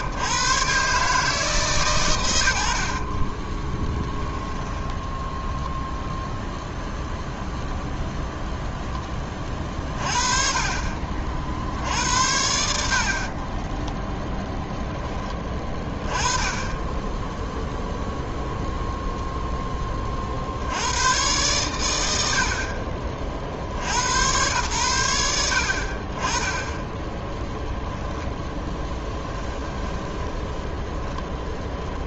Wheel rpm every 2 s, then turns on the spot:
120, 80, 10, 0, 0, 40, 60, 10, 10, 0, 90, 30, 100, 10, 10, 10.
4-6 28-32